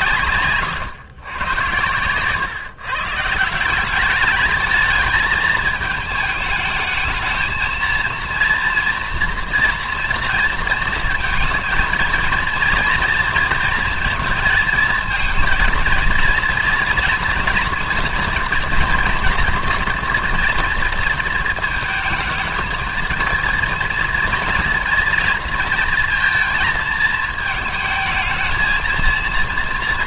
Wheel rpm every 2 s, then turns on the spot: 120, 140, 220, 220, 230, 230, 230, 220, 230, 230, 230, 220, 230, 230, 220.
none